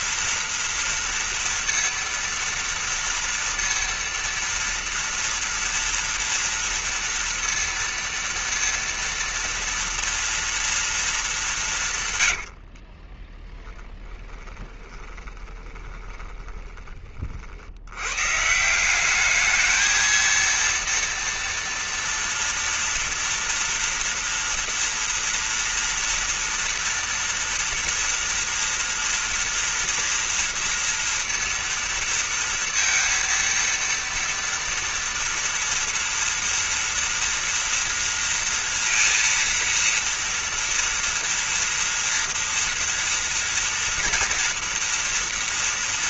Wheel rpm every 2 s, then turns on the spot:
230, 230, 230, 230, 230, 230, 140, 20, 20, 120, 220, 230, 230, 230, 230, 230, 230, 230, 230, 230, 230, 230, 240.
12-18